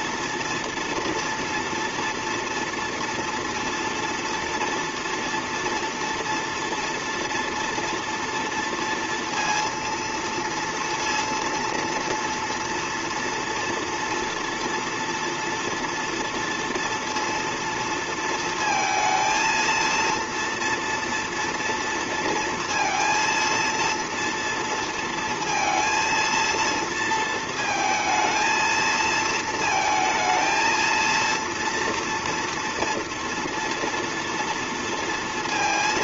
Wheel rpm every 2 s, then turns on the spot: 230, 230, 230, 230, 230, 230, 230, 230, 230, 230, 240, 230, 230, 230, 230, 220, 240, 230.
none